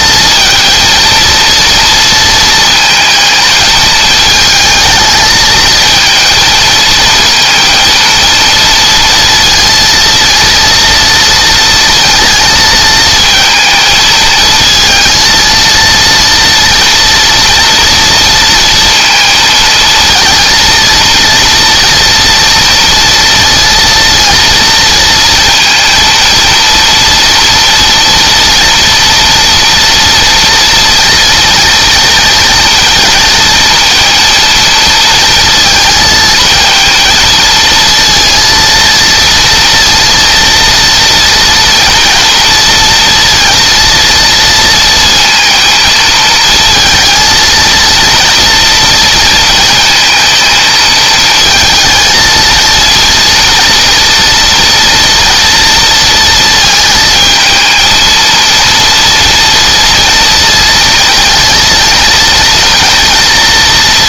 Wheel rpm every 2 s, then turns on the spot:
230, 230, 220, 230, 230, 230, 220, 230, 230, 230, 230, 230, 230, 230, 240, 230, 230, 230, 230, 230, 230, 230, 230, 230, 230, 220, 230, 230, 220, 230, 230, 230.
none